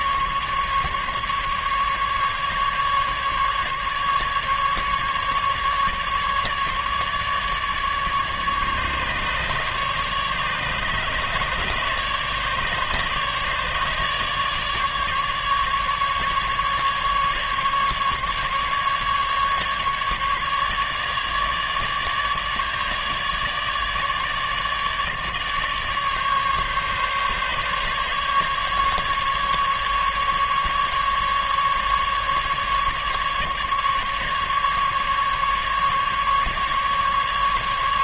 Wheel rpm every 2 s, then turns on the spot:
140, 150, 150, 150, 150, 150, 150, 150, 150, 140, 150, 150, 150, 140, 150, 150, 150, 140, 150.
none